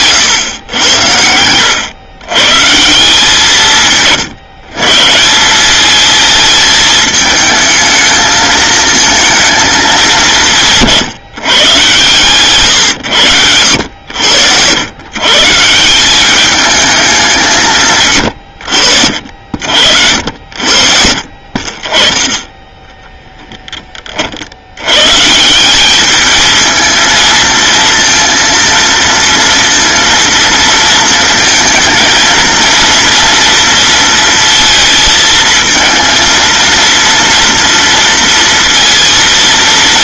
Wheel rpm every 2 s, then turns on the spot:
110, 140, 140, 220, 220, 150, 120, 90, 210, 70, 60, 20, 80, 220, 230, 230, 230, 230, 230, 230.
22-24